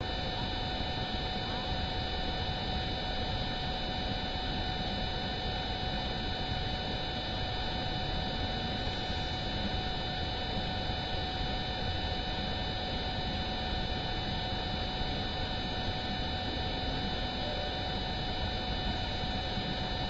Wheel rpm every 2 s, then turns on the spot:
0, 0, 0, 0, 0, 0, 0, 0, 0, 0.
none